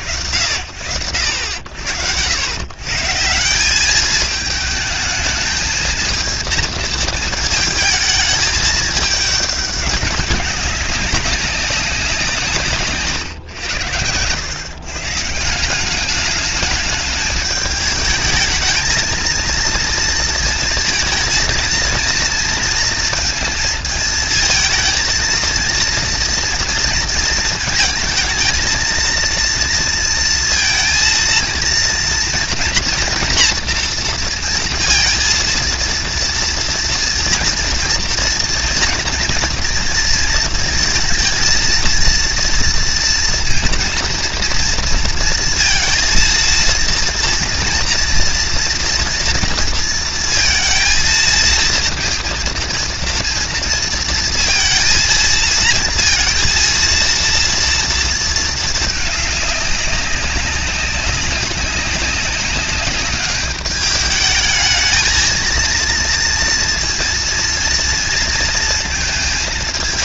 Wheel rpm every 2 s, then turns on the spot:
80, 100, 220, 220, 210, 200, 140, 140, 210, 220, 230, 230, 230, 230, 230, 230, 230, 230, 240, 230, 220, 230, 230, 230, 240, 230, 230, 230, 230, 210, 200, 200, 220, 230, 220.
none